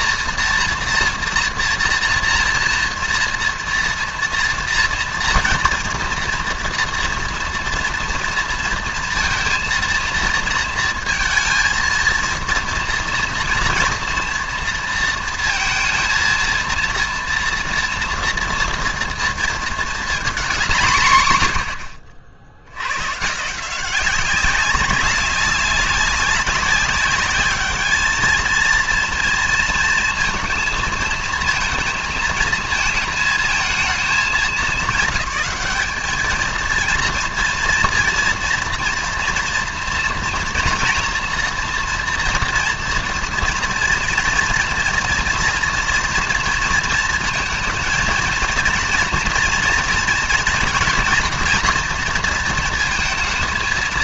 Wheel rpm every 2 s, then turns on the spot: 230, 230, 230, 230, 230, 230, 230, 230, 230, 230, 200, 80, 190, 190, 220, 230, 220, 200, 220, 230, 230, 230, 230, 230, 230, 240, 230.
none